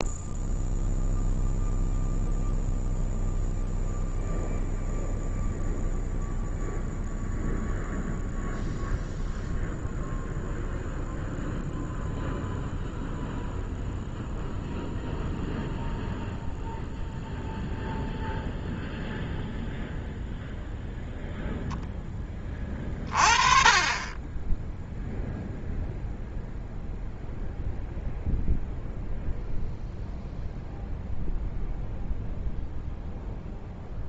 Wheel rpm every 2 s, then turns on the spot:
0, 0, 0, 0, 0, 0, 0, 0, 0, 0, 0, 30, 0, 0, 0, 0, 0.
none